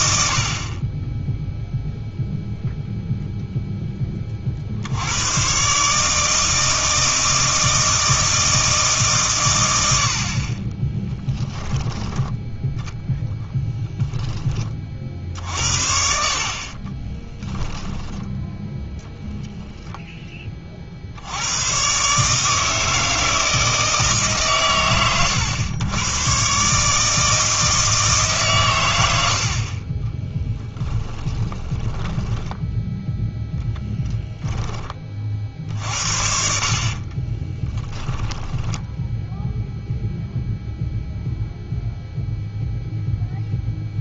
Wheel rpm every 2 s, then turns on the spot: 30, 0, 70, 160, 160, 30, 10, 40, 30, 0, 50, 160, 130, 140, 110, 10, 10, 20, 50, 10, 0, 0.
10-12 16-18 30-32 36-40